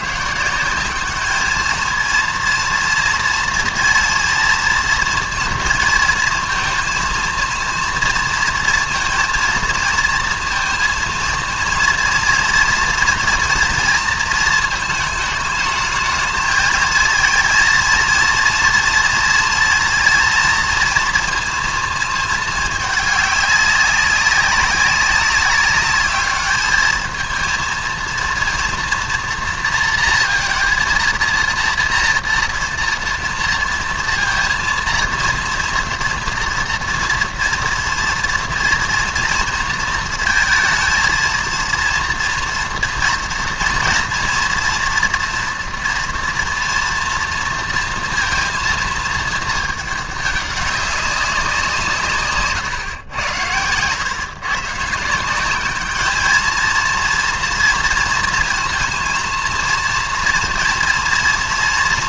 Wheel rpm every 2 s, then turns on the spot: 150, 230, 230, 230, 230, 230, 230, 230, 220, 230, 230, 220, 200, 200, 230, 230, 230, 230, 230, 230, 220, 230, 230, 230, 230, 210, 140, 120, 210, 230, 230.
none